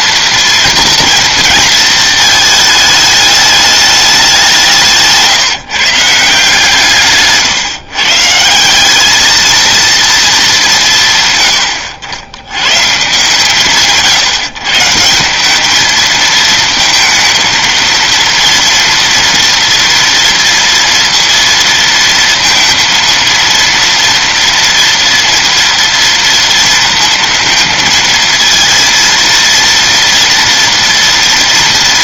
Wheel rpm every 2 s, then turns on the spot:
220, 190, 160, 150, 220, 90, 140, 220, 230, 230, 230, 240, 230, 230, 230, 230.
none